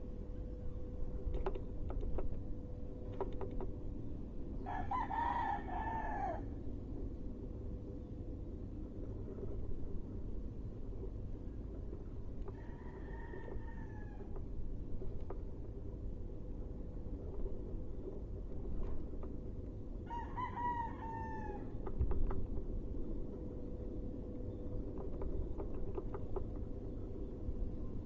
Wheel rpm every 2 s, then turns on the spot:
0, 0, 0, 0, 0, 0, 0, 0, 0, 0, 0, 0, 0, 0.
none